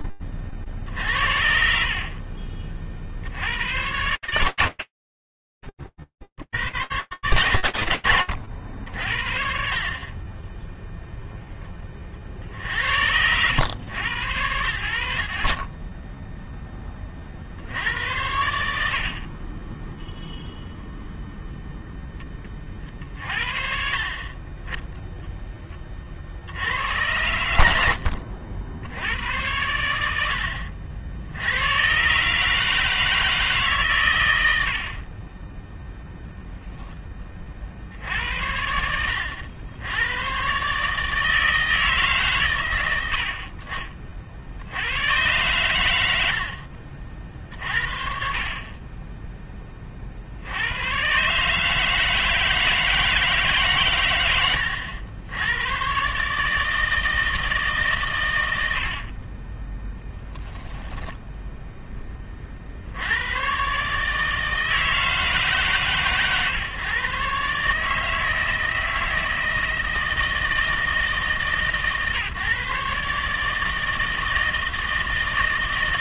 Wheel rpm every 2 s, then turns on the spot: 60, 50, 100, 100, 60, 10, 90, 70, 70, 20, 0, 40, 60, 60, 90, 150, 100, 0, 80, 140, 110, 90, 50, 30, 110, 160, 100, 160, 70, 0, 70, 160, 140, 160, 150, 140, 160, 160.
18-20 52-54